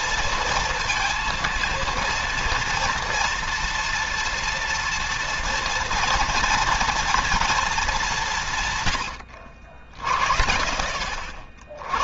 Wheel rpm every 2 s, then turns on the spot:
230, 230, 230, 230, 130, 70.
none